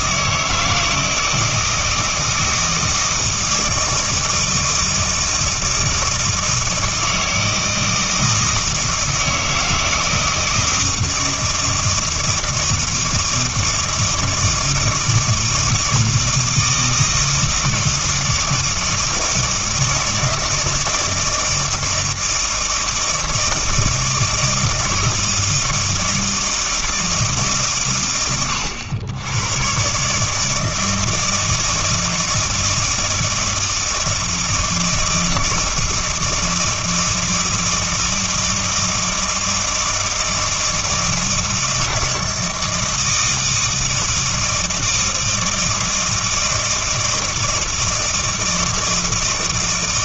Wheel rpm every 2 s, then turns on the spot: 160, 160, 160, 160, 160, 160, 160, 160, 160, 160, 160, 170, 170, 160, 90, 160, 160, 160, 160, 160, 160, 160, 160, 160, 160.
none